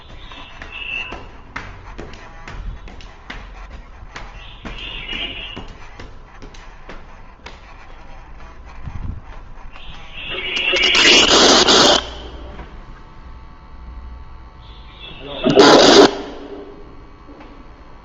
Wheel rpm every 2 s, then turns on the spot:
0, 0, 0, 0, 0, 0, 0, 0, 0.
none